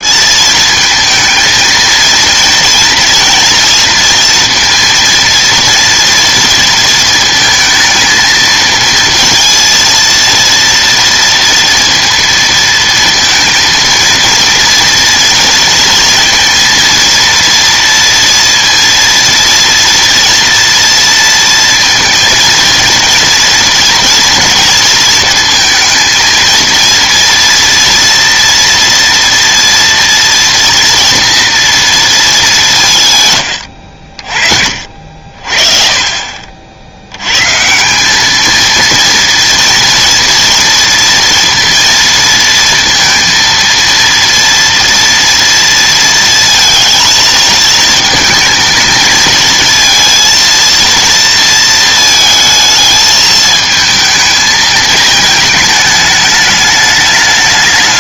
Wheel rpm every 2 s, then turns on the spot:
220, 230, 230, 230, 220, 230, 230, 230, 230, 230, 230, 230, 230, 230, 230, 230, 190, 50, 60, 220, 230, 230, 230, 220, 220, 230, 220, 220, 210.
none